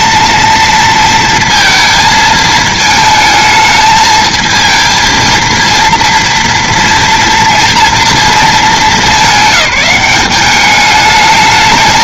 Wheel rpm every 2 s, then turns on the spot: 230, 220, 220, 230, 210, 200.
none